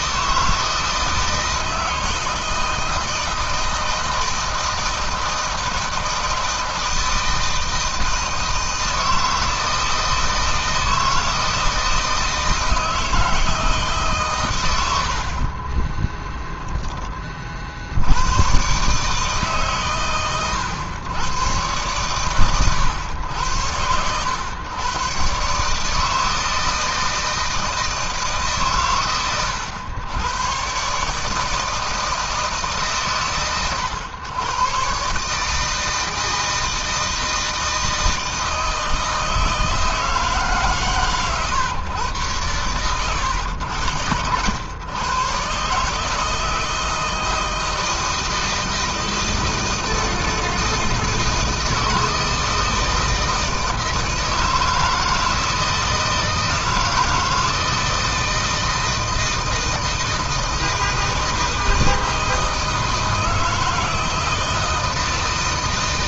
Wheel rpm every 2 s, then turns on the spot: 160, 160, 160, 160, 160, 160, 160, 60, 30, 140, 110, 100, 130, 160, 120, 150, 130, 140, 160, 160, 130, 100, 120, 160, 160, 160, 160, 160, 160, 160, 160, 160, 160.
14-16